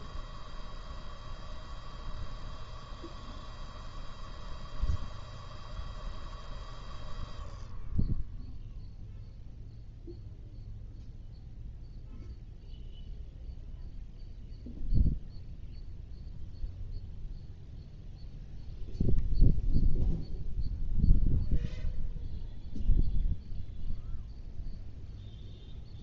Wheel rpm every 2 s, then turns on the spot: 0, 0, 0, 0, 0, 0, 0, 0, 0, 0, 0, 0, 0.
none